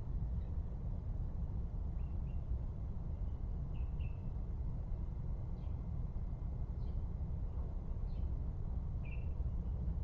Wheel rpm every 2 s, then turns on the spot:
0, 0, 0, 0, 0.
none